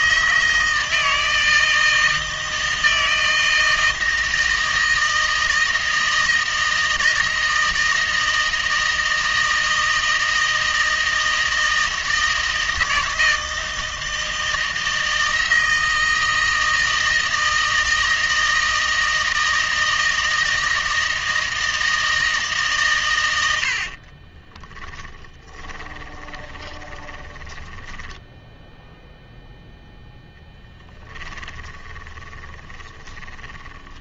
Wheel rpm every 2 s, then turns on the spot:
160, 160, 160, 160, 160, 160, 160, 160, 160, 160, 160, 140, 20, 20, 0, 10, 10.
24-28 30-34